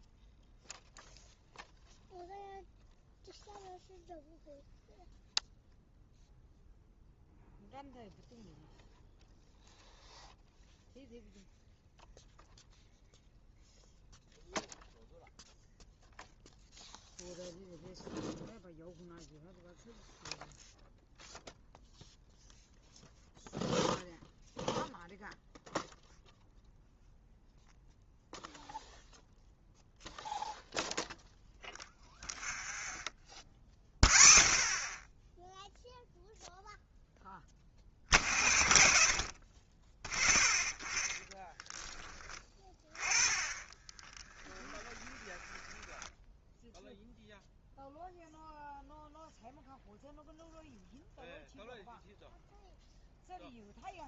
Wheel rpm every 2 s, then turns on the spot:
0, 0, 0, 0, 0, 0, 0, 0, 0, 0, 0, 0, 0, 0, 0, 0, 0, 0, 0, 60, 10, 20, 20, 0, 0, 0, 0.
42-46